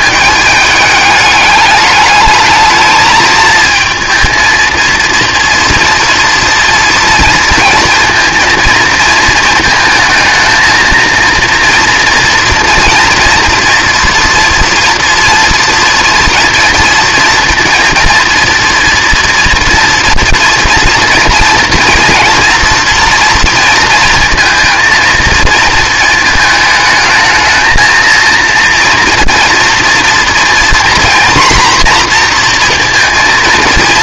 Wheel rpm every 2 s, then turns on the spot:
210, 210, 230, 230, 220, 230, 230, 230, 230, 230, 240, 230, 230, 220, 230, 230, 240.
none